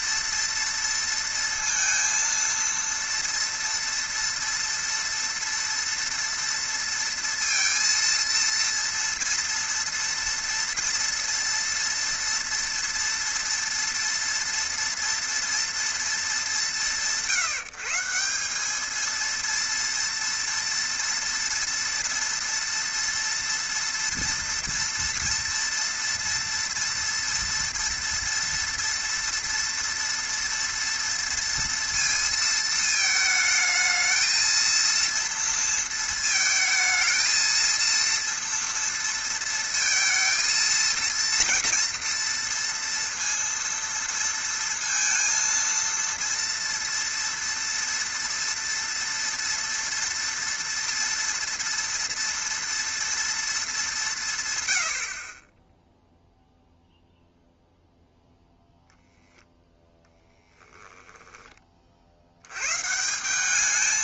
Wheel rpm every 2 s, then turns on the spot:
230, 230, 230, 230, 230, 240, 230, 230, 160, 200, 230, 230, 230, 230, 230, 230, 220, 230, 220, 230, 230, 230, 230, 230, 230, 230, 230, 90, 0, 0, 10, 130.
none